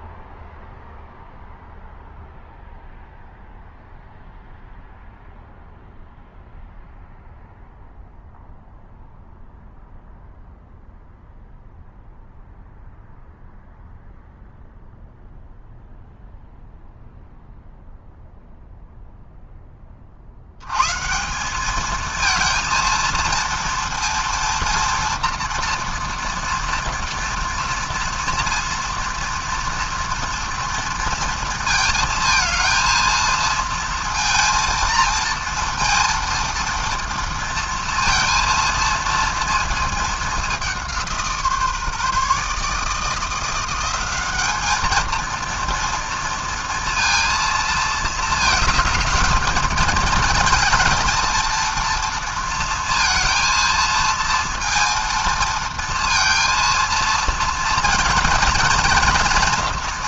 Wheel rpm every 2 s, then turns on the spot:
0, 0, 0, 0, 0, 0, 0, 0, 0, 0, 90, 230, 230, 230, 230, 230, 230, 230, 230, 230, 200, 150, 210, 230, 220, 220, 230, 230, 230, 230.
none